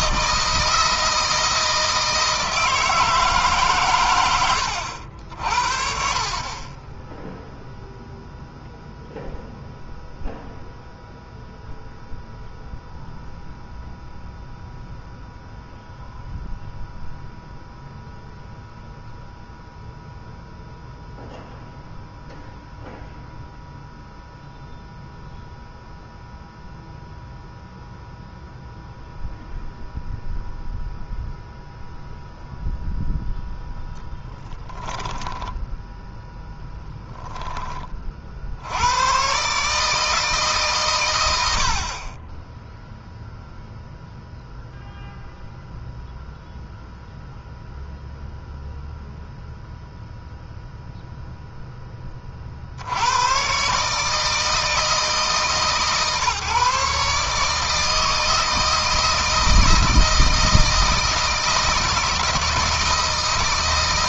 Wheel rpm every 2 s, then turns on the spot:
160, 160, 80, 20, 0, 0, 0, 0, 0, 0, 0, 0, 0, 0, 0, 0, 0, 20, 10, 100, 120, 0, 0, 0, 0, 0, 70, 160, 150, 160, 160, 160.
34-38